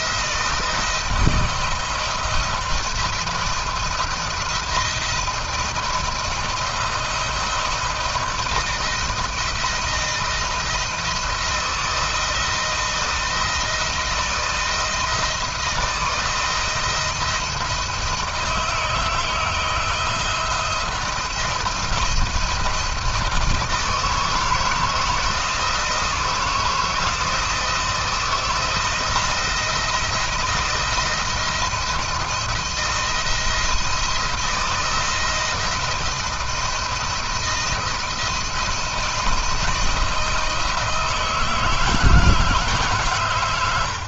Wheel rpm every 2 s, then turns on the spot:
170, 170, 170, 160, 170, 160, 170, 170, 160, 160, 170, 170, 160, 170, 170, 170, 170, 170, 170, 170, 160, 150.
none